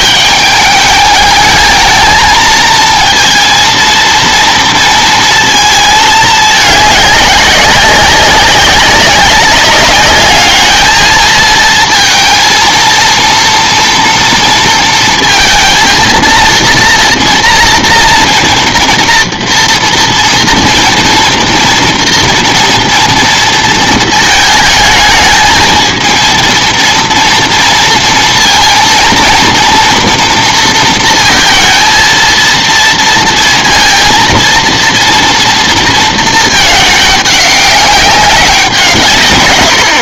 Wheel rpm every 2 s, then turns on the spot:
210, 220, 240, 210, 190, 220, 230, 230, 230, 230, 240, 230, 220, 230, 230, 230, 230, 230, 220, 180.
none